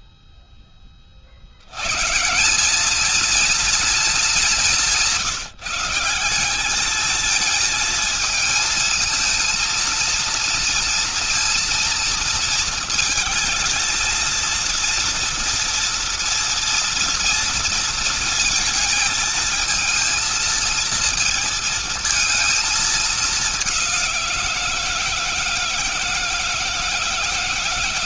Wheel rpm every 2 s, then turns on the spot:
0, 190, 200, 190, 220, 230, 230, 230, 230, 230, 220, 220, 170, 160.
none